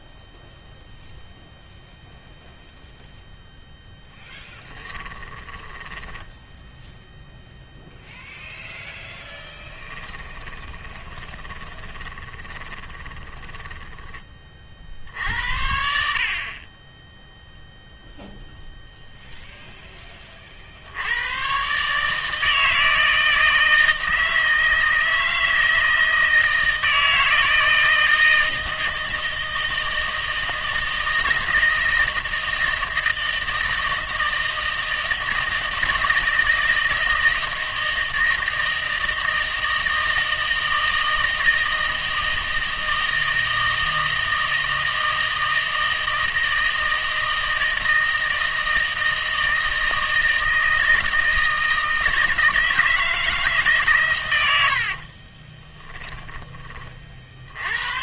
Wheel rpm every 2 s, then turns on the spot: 0, 0, 10, 0, 0, 20, 20, 50, 20, 0, 60, 160, 160, 160, 160, 160, 160, 160, 160, 160, 160, 160, 160, 160, 160, 160, 160, 70, 20.
4-6 10-14 54-56